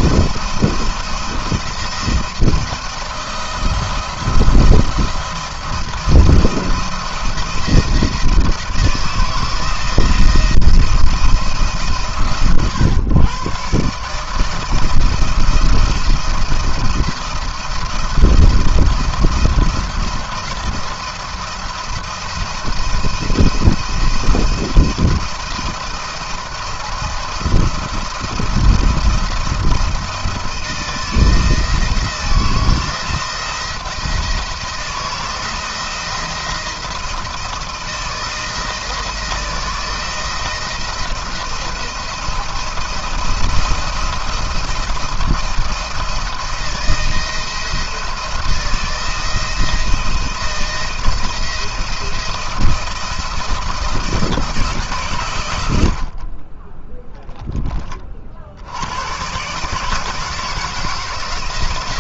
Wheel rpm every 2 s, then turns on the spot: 170, 170, 170, 160, 160, 170, 130, 160, 170, 170, 170, 160, 170, 170, 170, 160, 170, 170, 170, 160, 170, 170, 160, 160, 170, 170, 170, 170, 40, 80, 160.
none